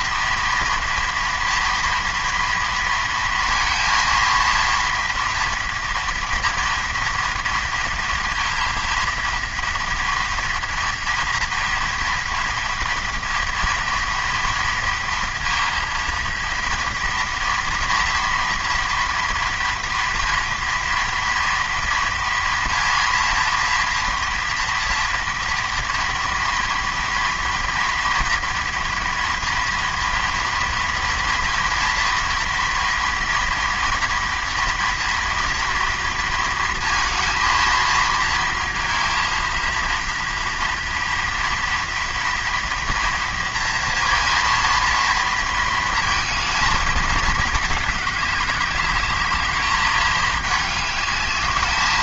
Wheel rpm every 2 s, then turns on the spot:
240, 230, 230, 230, 230, 230, 230, 230, 230, 240, 230, 240, 230, 230, 230, 230, 240, 230, 230, 230, 230, 230, 230, 210, 210, 210.
none